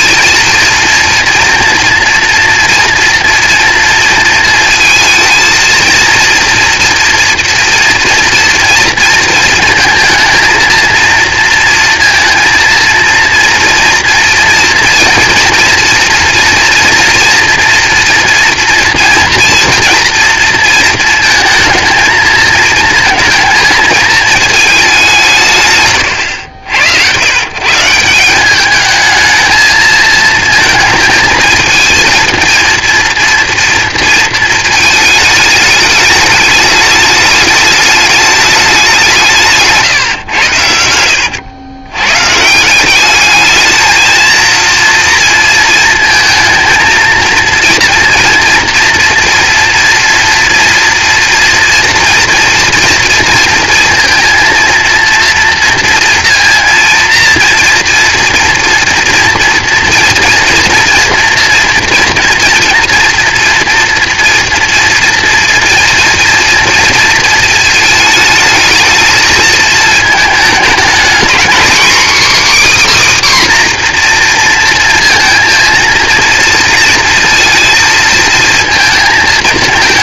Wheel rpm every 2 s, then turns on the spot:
230, 230, 220, 230, 230, 230, 230, 230, 230, 230, 220, 230, 210, 90, 210, 220, 230, 220, 210, 200, 90, 170, 230, 230, 240, 230, 230, 230, 230, 230, 230, 230, 230, 220, 220, 220, 280, 230, 230, 230.
none